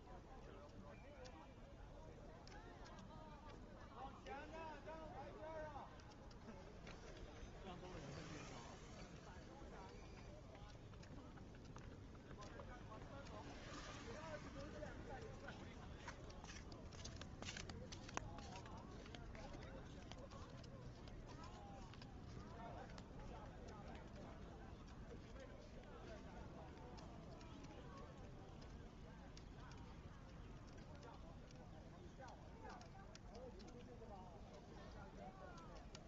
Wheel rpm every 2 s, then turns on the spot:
0, 0, 0, 0, 0, 0, 0, 0, 0, 0, 0, 0, 0, 0, 0, 0, 0, 0.
none